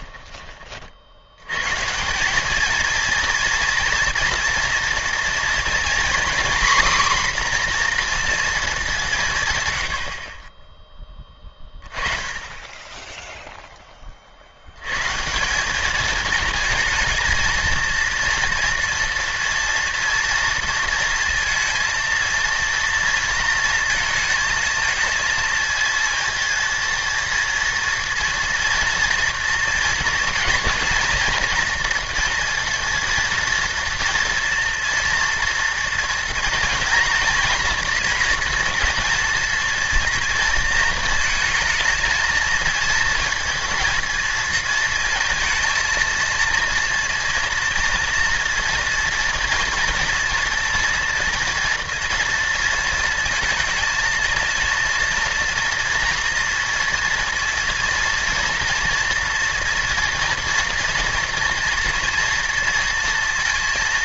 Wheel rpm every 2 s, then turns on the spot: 30, 220, 230, 260, 210, 20, 20, 90, 220, 230, 230, 230, 220, 220, 230, 230, 230, 230, 230, 230, 230, 220, 230, 230, 230, 230, 230, 230, 240, 230, 230, 230.
none